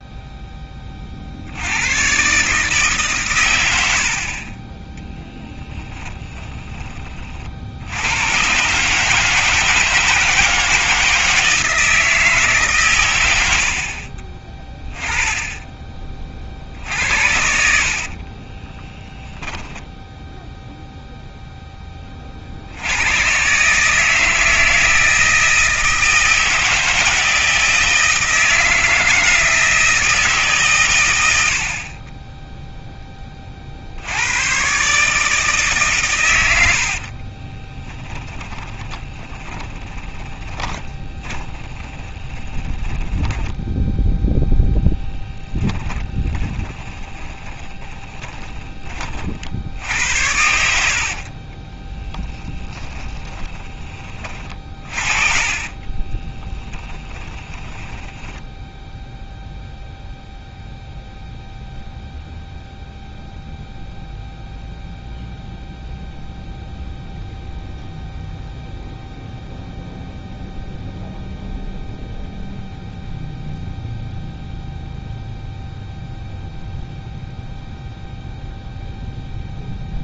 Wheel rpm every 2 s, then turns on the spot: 20, 150, 10, 30, 140, 160, 130, 10, 60, 10, 0, 80, 160, 160, 160, 130, 0, 130, 70, 20, 20, 20, 10, 20, 30, 70, 20, 40, 20, 0, 0, 0, 0, 0, 0, 0, 0, 0, 0, 0.
18-20 36-48 50-58